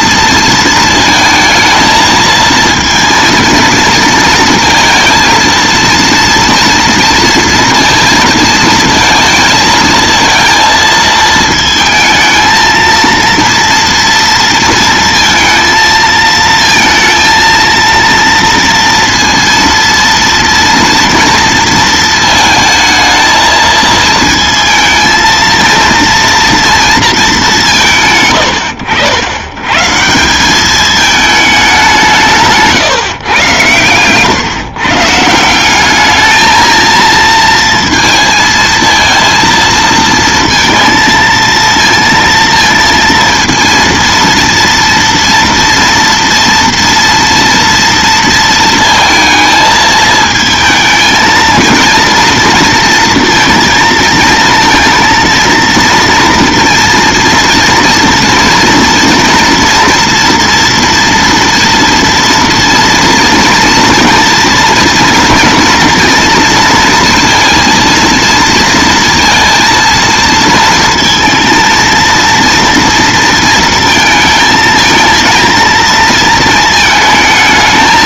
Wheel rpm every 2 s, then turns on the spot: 230, 230, 230, 230, 230, 230, 230, 230, 220, 230, 230, 220, 220, 230, 80, 210, 150, 140, 220, 230, 230, 230, 230, 230, 230, 220, 230, 230, 230, 230, 230, 230, 240, 230, 230, 230, 230, 220, 220.
none